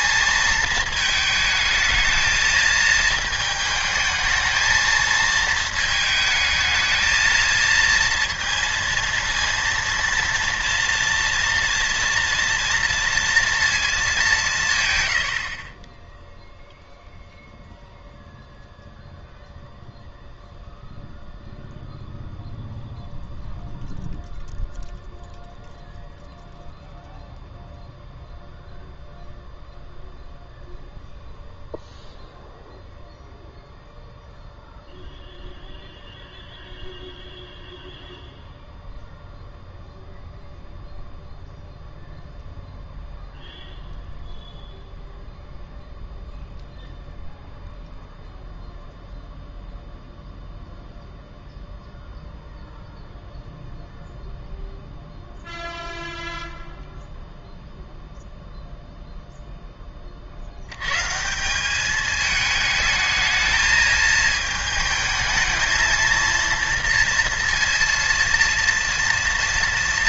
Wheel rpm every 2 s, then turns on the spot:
220, 220, 220, 220, 230, 230, 230, 160, 0, 0, 0, 0, 0, 0, 0, 0, 0, 0, 0, 0, 0, 0, 0, 0, 0, 0, 0, 0, 0, 0, 90, 220, 220, 230, 230.
none